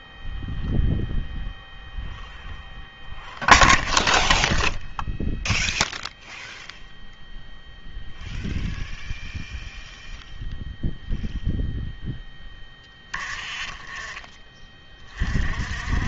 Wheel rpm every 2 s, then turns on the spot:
0, 0, 0, 0, 0, 0, 10, 30.
none